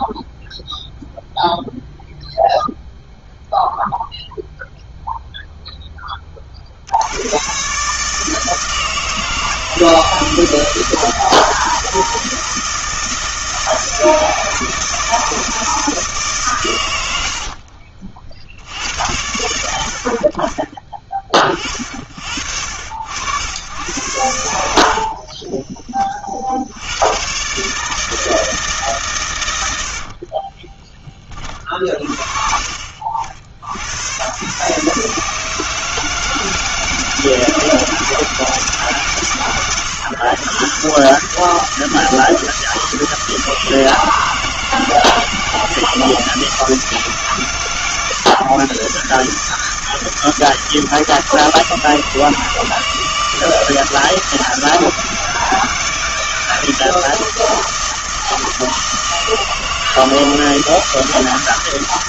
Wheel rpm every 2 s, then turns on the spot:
0, 0, 0, 40, 160, 160, 160, 160, 140, 70, 30, 60, 80, 60, 160, 30, 50, 120, 160, 160, 130, 160, 160, 160, 130, 160, 160, 160, 160, 160, 160.
24-26 30-32